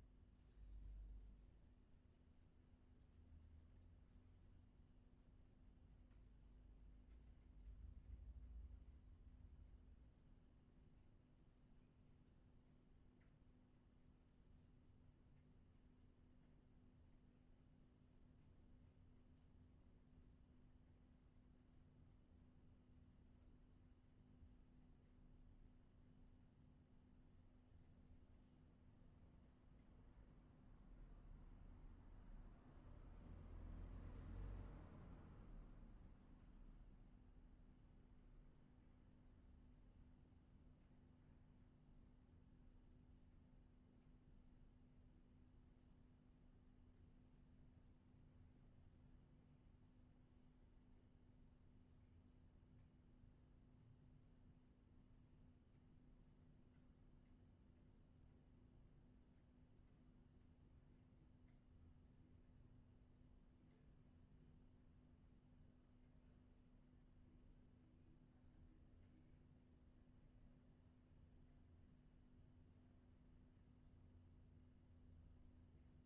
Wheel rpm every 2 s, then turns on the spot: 0, 0, 0, 0, 0, 0, 0, 0, 0, 0, 0, 0, 0, 0, 0, 0, 0, 0, 0, 0, 0, 0, 0, 0, 0, 0, 0, 0, 0, 0, 0, 0, 0, 0, 0, 0, 0, 0.
none